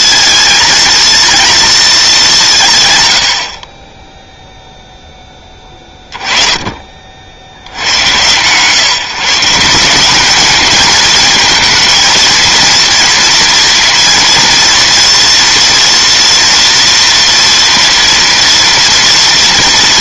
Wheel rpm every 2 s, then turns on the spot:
230, 160, 0, 20, 130, 220, 230, 230, 240, 230.
none